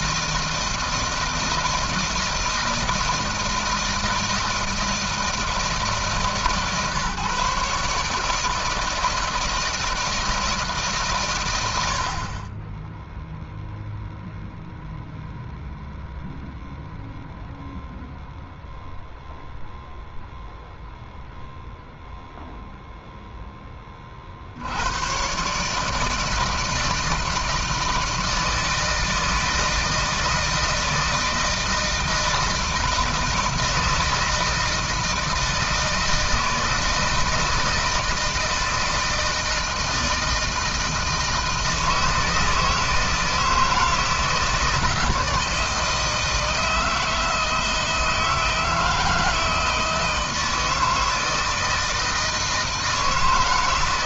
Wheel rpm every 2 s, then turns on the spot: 160, 160, 160, 150, 160, 150, 20, 0, 0, 0, 0, 0, 70, 160, 160, 160, 160, 160, 160, 160, 160, 160, 160, 160, 160, 160, 160.
none